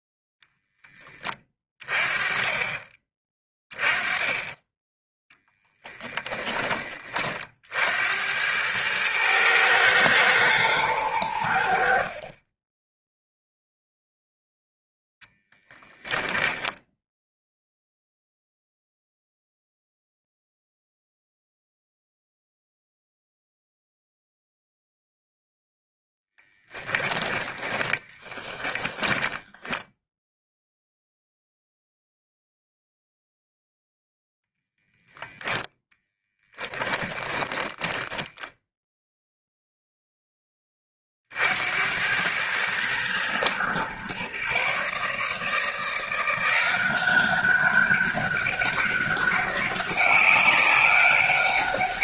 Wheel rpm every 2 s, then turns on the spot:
10, 30, 10, 30, 110, 110, 20, 0, 10, 0, 0, 0, 0, 20, 30, 0, 0, 0, 20, 0, 30, 110, 140, 180, 190, 200.
26-30 36-38